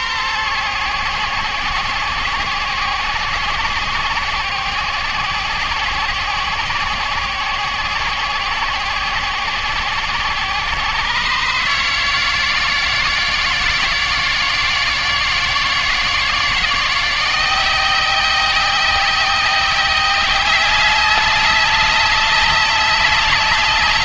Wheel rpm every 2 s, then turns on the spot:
130, 120, 130, 130, 130, 130, 170, 170, 170, 190, 200, 200.
none